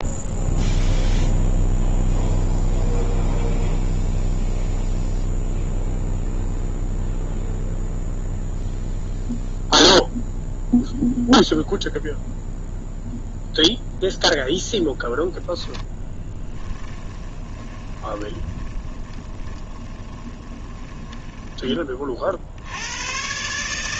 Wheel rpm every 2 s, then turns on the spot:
0, 0, 0, 0, 0, 0, 0, 0, 10, 20, 20, 70.
16-22